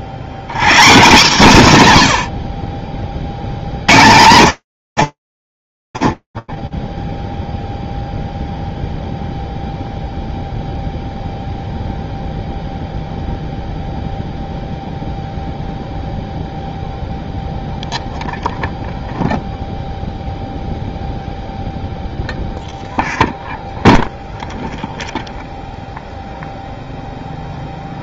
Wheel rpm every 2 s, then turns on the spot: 120, 70, 70, 0, 0, 0, 0, 0, 0, 0, 0, 0, 0, 0.
none